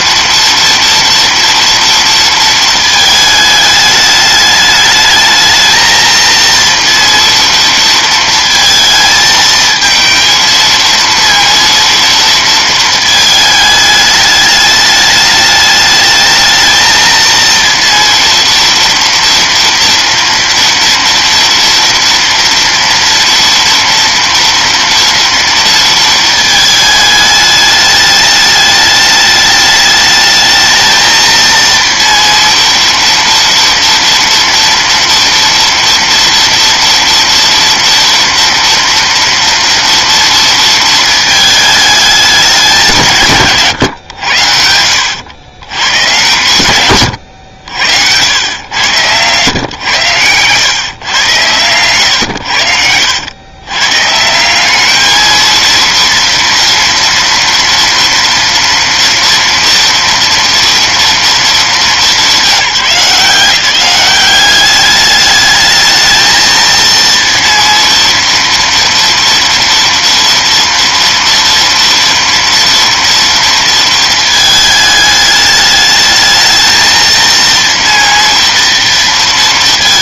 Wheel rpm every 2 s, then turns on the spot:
230, 220, 210, 230, 220, 230, 220, 210, 220, 230, 230, 230, 230, 220, 210, 220, 230, 230, 230, 230, 230, 190, 90, 130, 110, 120, 90, 200, 230, 230, 230, 180, 200, 230, 230, 230, 230, 220, 220, 230.
44-46